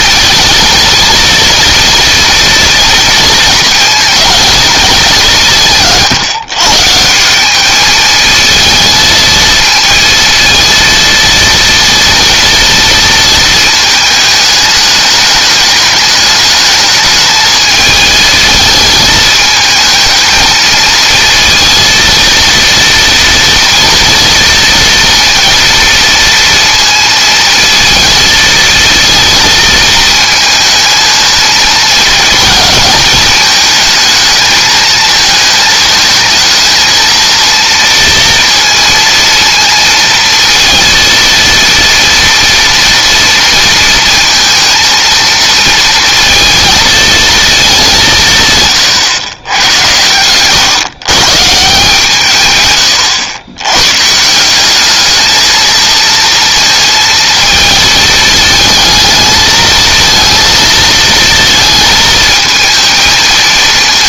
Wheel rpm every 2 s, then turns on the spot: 230, 230, 220, 150, 220, 230, 230, 210, 210, 220, 220, 230, 230, 230, 230, 220, 220, 220, 220, 230, 230, 230, 230, 230, 130, 120, 120, 200, 230, 220, 230, 230.
none